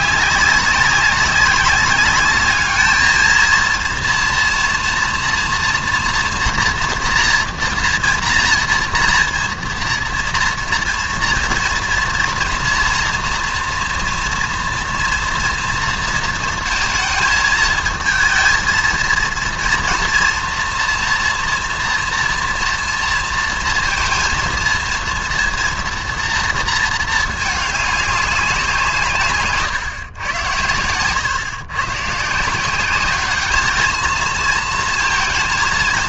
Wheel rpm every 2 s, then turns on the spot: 200, 210, 240, 240, 230, 230, 230, 230, 230, 230, 230, 230, 230, 230, 190, 110, 180, 230.
none